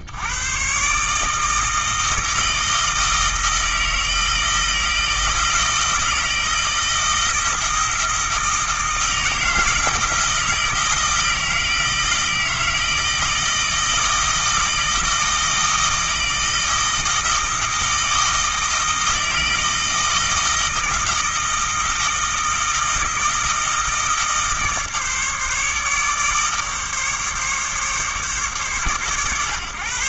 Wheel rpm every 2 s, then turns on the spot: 120, 160, 160, 160, 160, 160, 160, 160, 160, 160, 160, 160, 150, 150, 130.
none